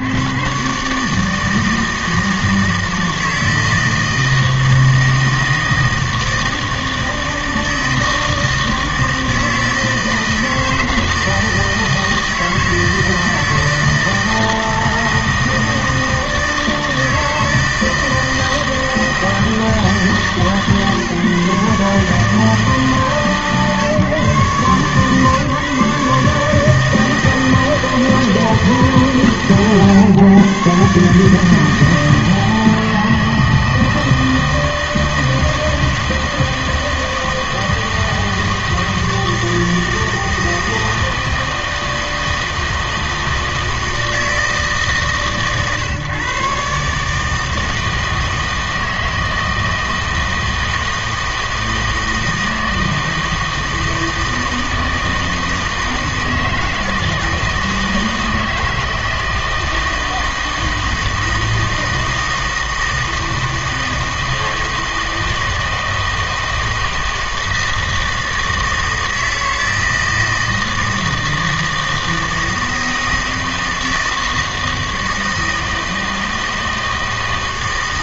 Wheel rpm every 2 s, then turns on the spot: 120, 160, 160, 160, 160, 160, 160, 160, 160, 160, 150, 160, 140, 160, 160, 130, 160, 160, 160, 160, 160, 160, 160, 140, 160, 160, 160, 160, 160, 160, 160, 160, 160, 160, 160, 160, 160, 160, 160.
none